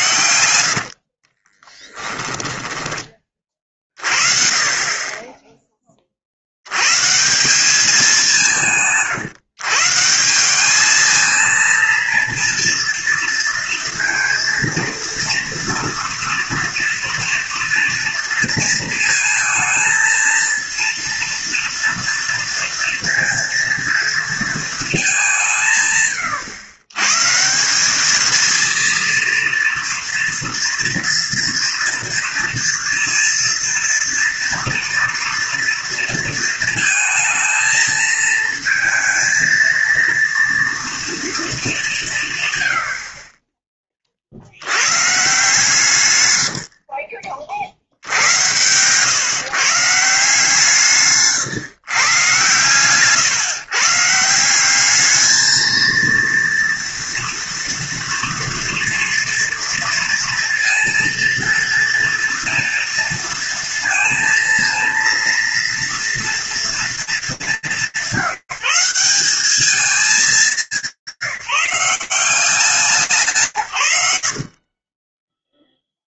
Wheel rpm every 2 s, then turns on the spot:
80, 10, 40, 70, 170, 190, 230, 230, 230, 230, 230, 230, 230, 130, 220, 230, 230, 230, 230, 230, 230, 140, 60, 90, 100, 160, 130, 170, 230, 230, 230, 230, 230, 230, 180, 180, 130, 0.
0-4 46-50